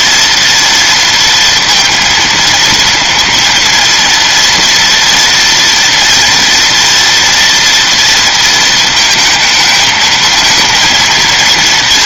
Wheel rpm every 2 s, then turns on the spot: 230, 230, 240, 230, 220, 230.
none